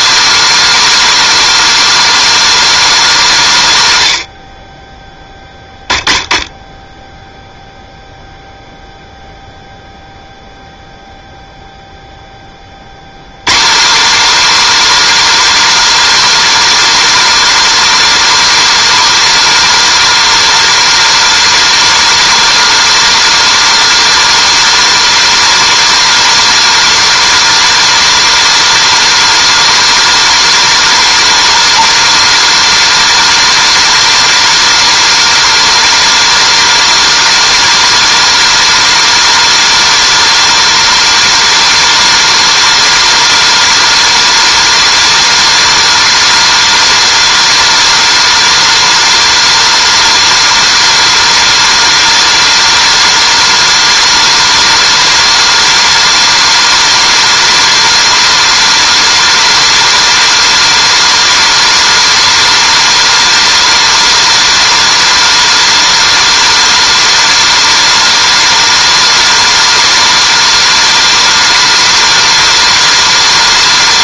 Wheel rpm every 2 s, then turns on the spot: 310, 310, 50, 10, 0, 0, 50, 300, 310, 310, 310, 310, 310, 310, 310, 310, 310, 310, 310, 310, 310, 310, 310, 310, 310, 310, 310, 310, 310, 310, 310, 310, 310, 310, 310, 310, 310.
none